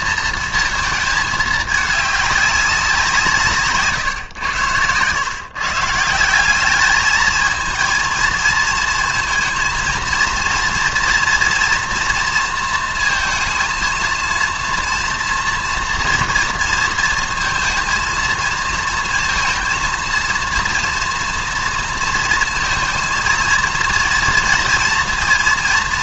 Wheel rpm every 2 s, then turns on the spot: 230, 200, 110, 200, 220, 230, 230, 230, 230, 230, 230, 220, 230.
none